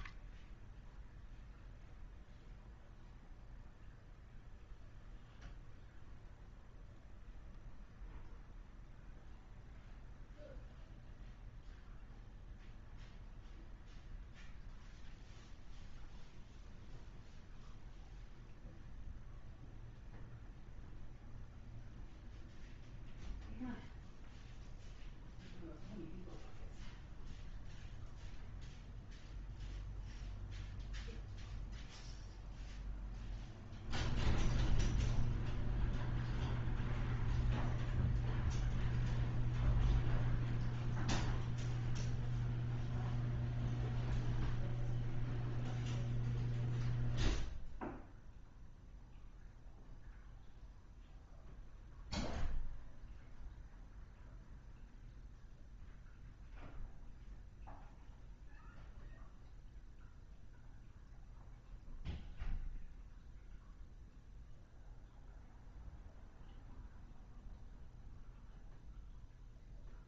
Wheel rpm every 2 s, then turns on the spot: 0, 0, 0, 0, 0, 0, 0, 0, 0, 0, 0, 0, 0, 0, 0, 0, 0, 0, 0, 0, 0, 0, 0, 0, 0, 0, 0, 0, 0, 0, 0, 0, 0, 0, 0.
none